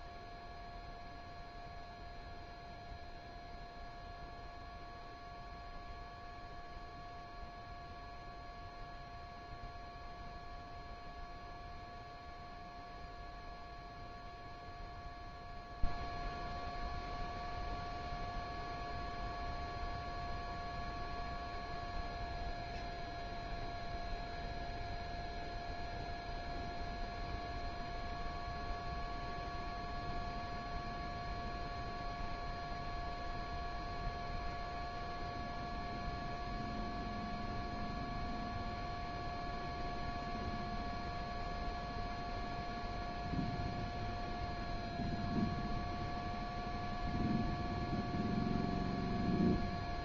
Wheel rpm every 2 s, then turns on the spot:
0, 0, 0, 0, 0, 0, 0, 0, 0, 0, 0, 0, 0, 0, 0, 0, 0, 0, 0, 0, 0, 0, 0, 0, 0.
none